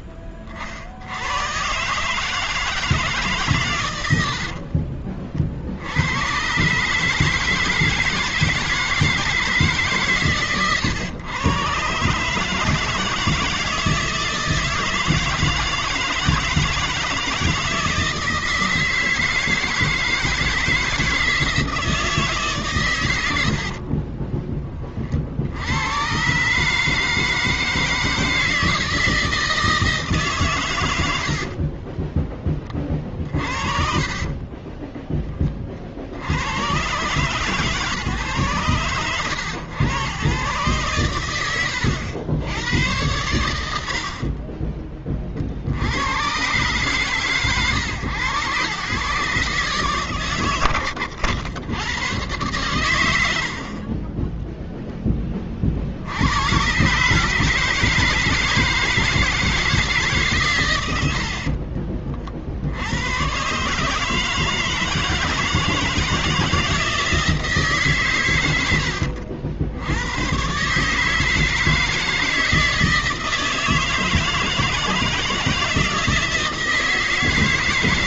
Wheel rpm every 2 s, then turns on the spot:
30, 150, 50, 120, 160, 140, 150, 160, 160, 160, 160, 140, 30, 140, 160, 150, 20, 20, 70, 110, 130, 100, 30, 100, 110, 120, 110, 10, 120, 160, 120, 70, 160, 160, 120, 130, 160, 160, 160.
4-6 34-36